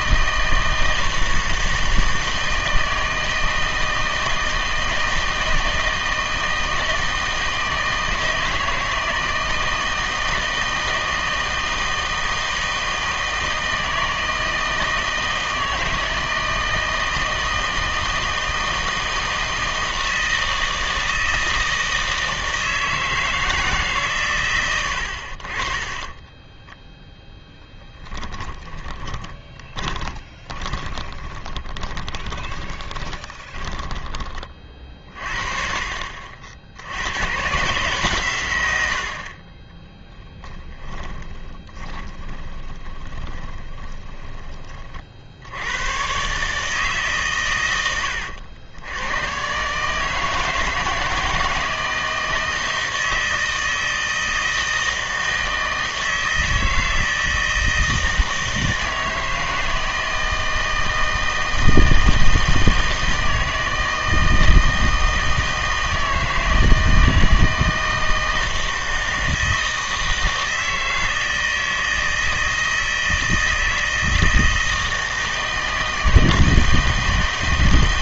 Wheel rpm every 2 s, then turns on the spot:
160, 160, 160, 160, 160, 160, 160, 160, 160, 160, 160, 160, 90, 10, 20, 20, 10, 40, 70, 100, 20, 20, 30, 150, 90, 160, 160, 160, 160, 160, 160, 160, 160, 160, 160, 160, 160, 160, 160.
26-34 40-44